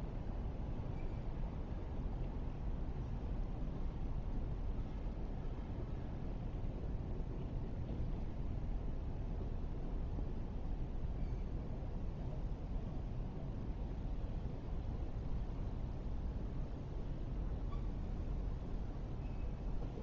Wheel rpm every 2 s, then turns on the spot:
0, 0, 0, 0, 0, 0, 0, 0, 0, 0.
none